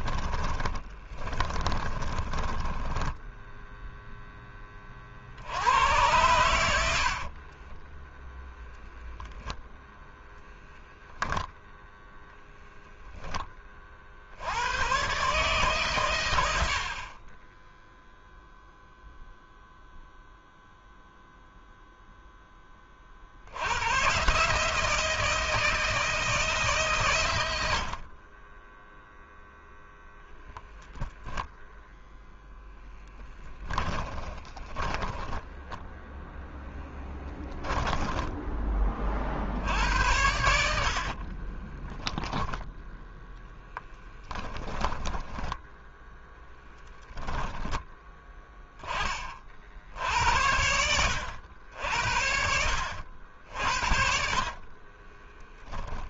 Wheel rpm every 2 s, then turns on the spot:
20, 10, 40, 50, 0, 0, 10, 120, 50, 0, 0, 30, 160, 140, 10, 0, 10, 20, 10, 30, 60, 10, 10, 10, 20, 80, 60, 30.
0-4 6-8 34-38 40-42 44-46 54-56